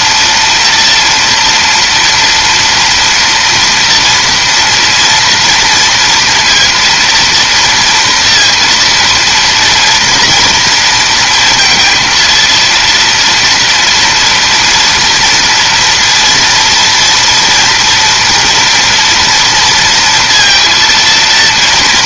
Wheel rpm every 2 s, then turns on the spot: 230, 240, 230, 230, 230, 230, 230, 230, 230, 230, 230.
none